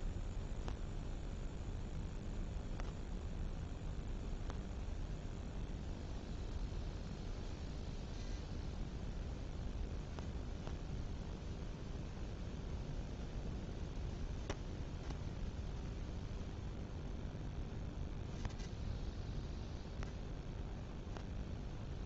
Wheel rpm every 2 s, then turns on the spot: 0, 0, 0, 0, 0, 0, 0, 0, 0, 0, 0.
none